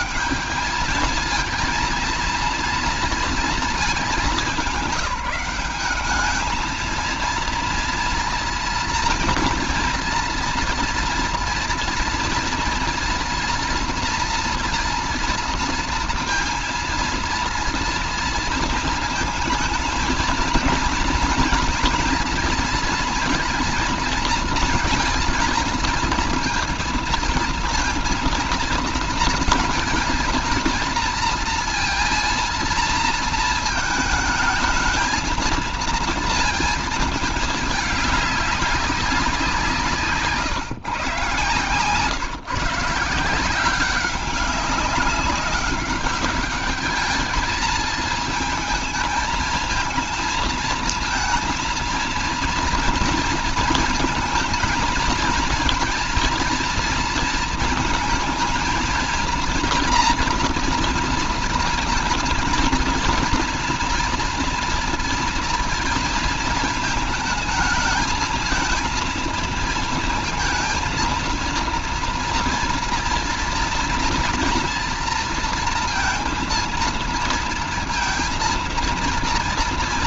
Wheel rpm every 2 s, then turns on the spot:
210, 230, 210, 210, 230, 230, 230, 230, 230, 230, 220, 230, 230, 230, 230, 230, 230, 220, 230, 210, 150, 150, 200, 210, 220, 220, 230, 220, 230, 230, 230, 230, 230, 230, 220, 230, 230, 230, 230, 230.
none